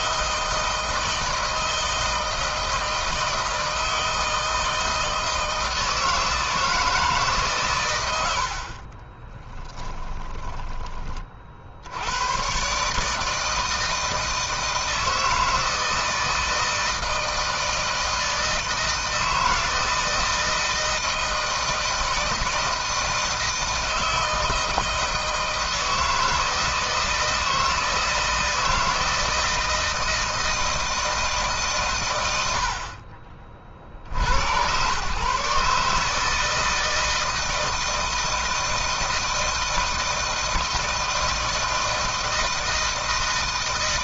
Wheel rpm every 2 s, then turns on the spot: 160, 160, 160, 160, 60, 30, 130, 160, 160, 160, 160, 160, 160, 160, 160, 160, 100, 90, 160, 160, 160, 160.
8-12